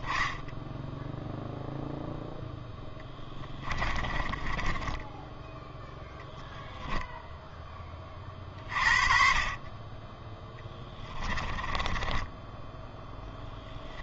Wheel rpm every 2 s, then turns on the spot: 0, 10, 30, 0, 40, 10, 20.
2-6 10-12